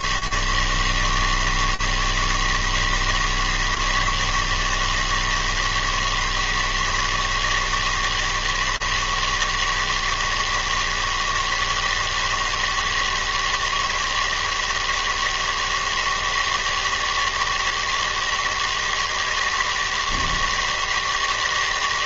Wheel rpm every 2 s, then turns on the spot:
90, 160, 160, 160, 160, 160, 160, 160, 160, 160, 160.
none